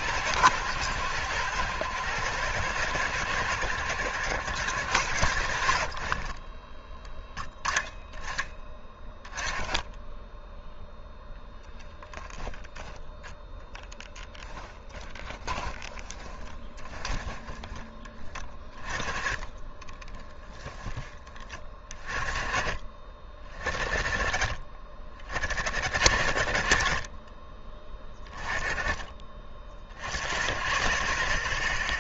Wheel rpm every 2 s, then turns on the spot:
100, 110, 90, 20, 20, 0, 10, 10, 20, 20, 20, 30, 30, 40, 20, 70.
14-18 20-22 26-28